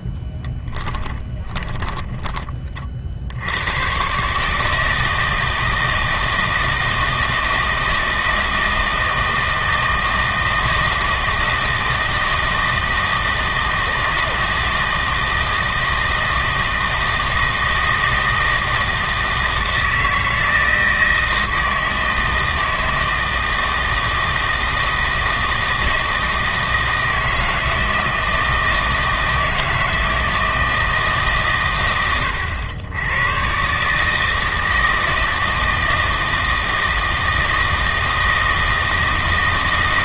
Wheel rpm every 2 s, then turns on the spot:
10, 30, 160, 160, 160, 160, 160, 160, 160, 160, 160, 160, 160, 160, 160, 160, 90, 160, 160, 160.
0-2